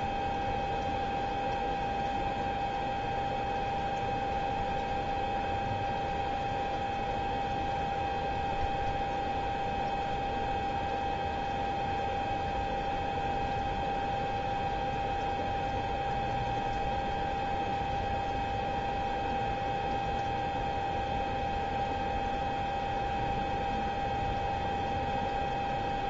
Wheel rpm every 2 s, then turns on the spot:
0, 0, 0, 0, 0, 0, 0, 0, 0, 0, 0, 0, 0.
none